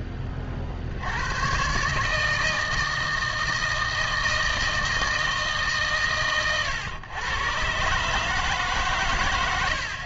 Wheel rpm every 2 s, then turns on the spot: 60, 160, 160, 100, 150.
none